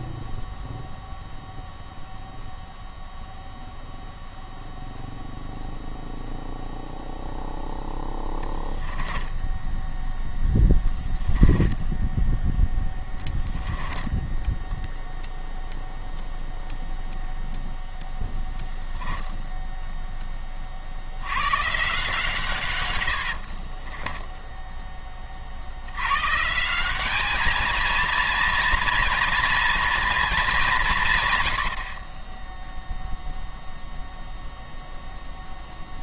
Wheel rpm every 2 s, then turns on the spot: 0, 0, 0, 0, 10, 0, 10, 0, 0, 0, 70, 90, 20, 200, 230, 150, 0, 0.
22-24